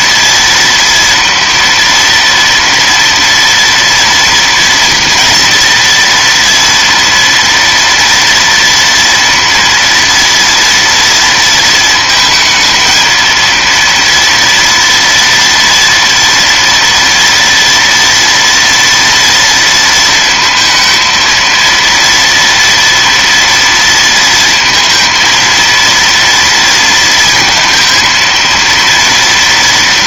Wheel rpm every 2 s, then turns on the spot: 230, 230, 230, 230, 230, 230, 220, 230, 230, 230, 230, 230, 230, 230, 230.
none